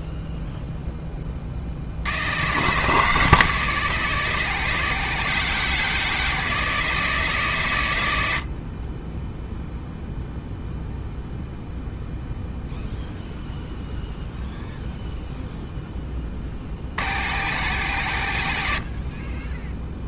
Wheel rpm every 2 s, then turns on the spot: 10, 140, 150, 160, 40, 0, 0, 0, 50, 80.
none